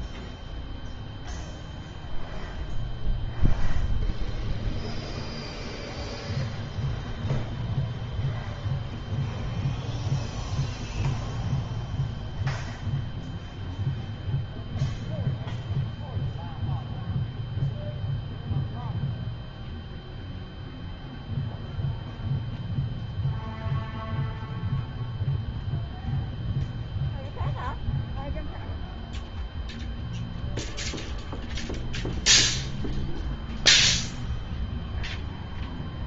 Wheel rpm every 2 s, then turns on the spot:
0, 0, 0, 0, 0, 0, 0, 0, 0, 0, 0, 0, 0, 0, 0, 0, 0, 0.
none